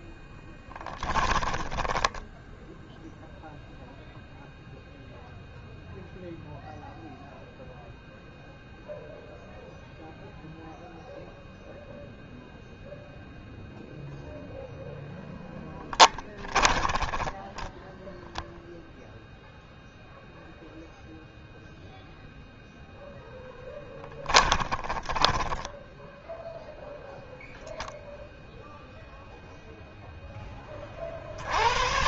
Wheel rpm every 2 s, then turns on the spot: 10, 0, 0, 0, 0, 0, 0, 10, 0, 0, 0, 10, 0, 0, 10, 130.
14-16 22-24